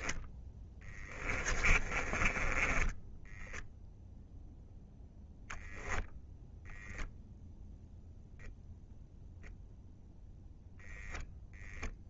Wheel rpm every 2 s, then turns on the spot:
10, 10, 10, 0, 0, 0.
0-4